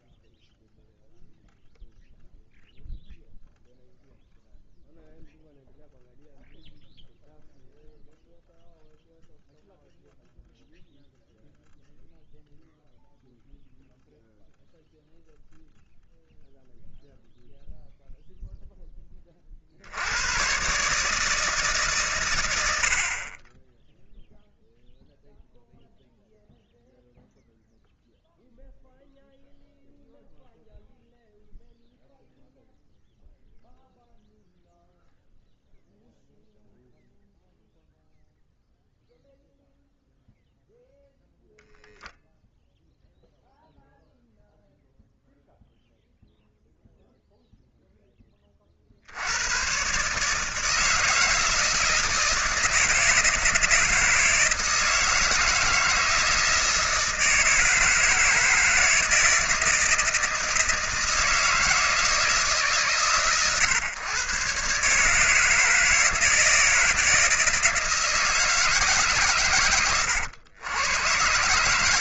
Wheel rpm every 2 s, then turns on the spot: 0, 0, 0, 0, 0, 0, 0, 0, 0, 10, 130, 80, 0, 0, 0, 0, 0, 0, 0, 0, 0, 0, 0, 0, 50, 150, 160, 160, 160, 160, 160, 140, 140, 160, 150, 110.
none